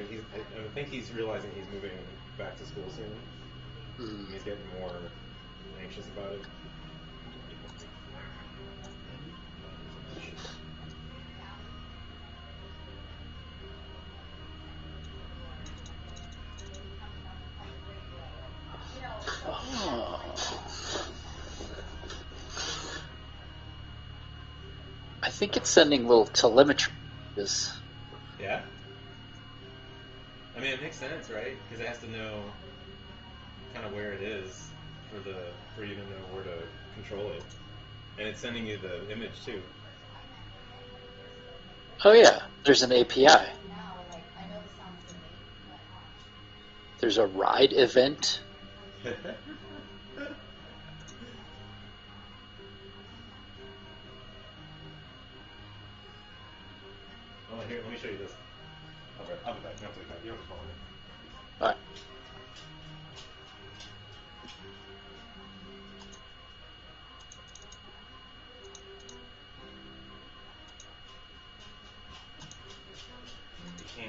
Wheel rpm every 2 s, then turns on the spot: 0, 0, 0, 0, 0, 0, 0, 0, 0, 0, 0, 0, 0, 0, 0, 0, 0, 0, 0, 0, 0, 0, 0, 0, 0, 0, 0, 0, 0, 0, 0, 0, 0, 0, 0, 0, 0.
none